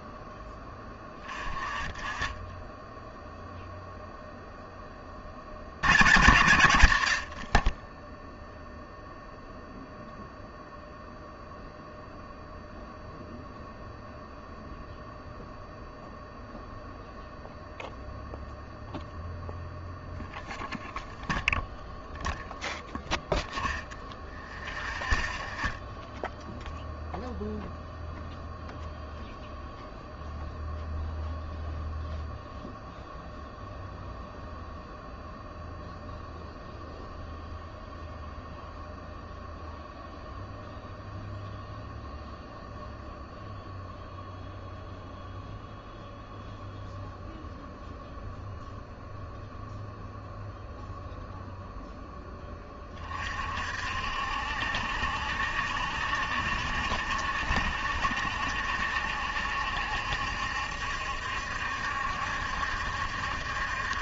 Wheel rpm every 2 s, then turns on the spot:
20, 10, 10, 60, 0, 0, 0, 0, 0, 0, 0, 0, 0, 0, 0, 0, 0, 0, 0, 0, 0, 0, 0, 0, 0, 0, 30, 70, 70, 70, 70, 70.
none